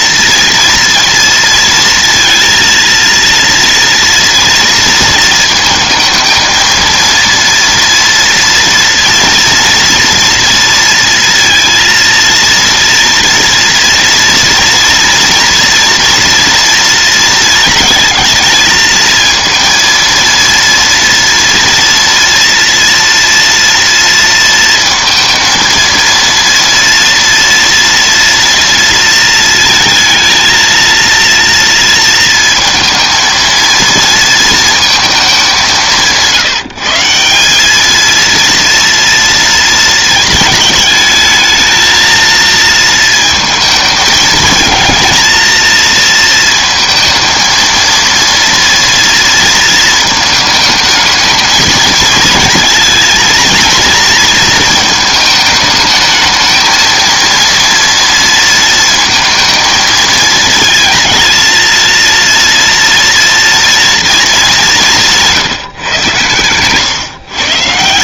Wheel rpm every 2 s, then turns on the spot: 230, 230, 230, 230, 230, 230, 230, 230, 230, 220, 230, 230, 230, 230, 230, 230, 230, 220, 160, 230, 210, 230, 220, 230, 230, 220, 220, 220, 230, 230, 230, 230, 190, 140.
none